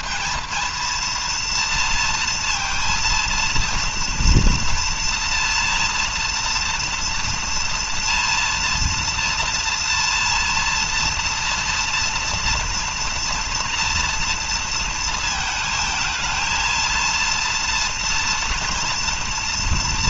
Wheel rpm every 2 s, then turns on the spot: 230, 230, 230, 230, 230, 230, 230, 230, 230, 230.
none